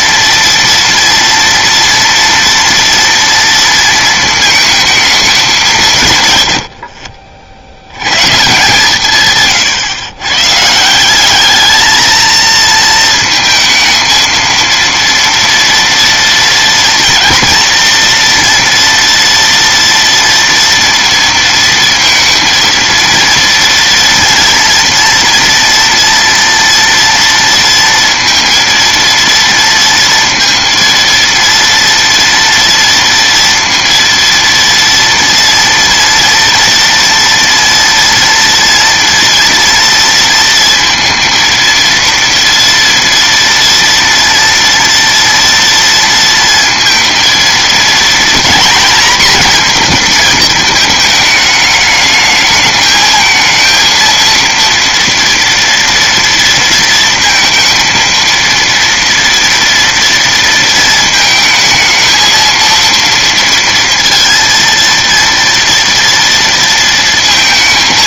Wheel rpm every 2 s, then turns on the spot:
230, 230, 220, 60, 140, 170, 230, 230, 230, 230, 230, 230, 230, 230, 230, 230, 230, 230, 230, 230, 230, 240, 230, 230, 240, 220, 220, 230, 230, 230, 230, 230, 230, 230.
none